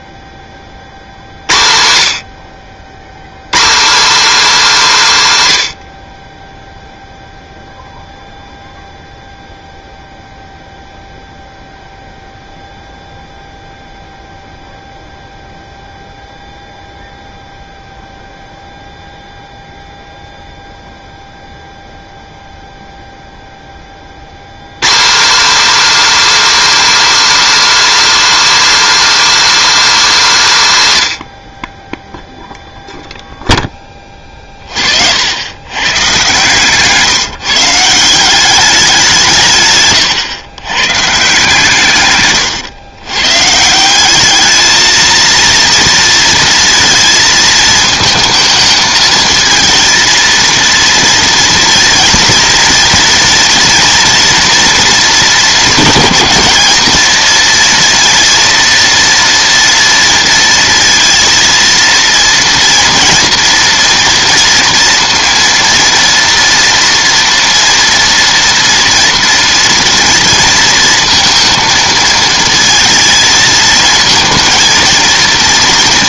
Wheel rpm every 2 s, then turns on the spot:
30, 70, 260, 10, 0, 0, 0, 0, 0, 0, 0, 0, 120, 310, 310, 190, 0, 40, 140, 190, 120, 120, 220, 230, 220, 230, 230, 230, 220, 240, 230, 240, 230, 230, 230, 230, 230, 230.
none